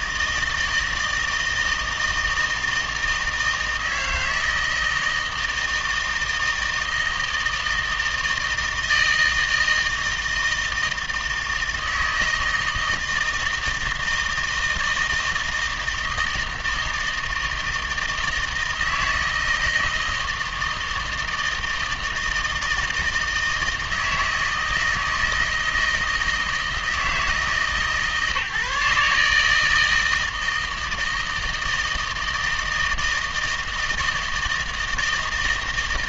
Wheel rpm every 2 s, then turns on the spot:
160, 160, 160, 160, 160, 160, 160, 160, 160, 160, 160, 160, 160, 160, 150, 160, 160, 160.
none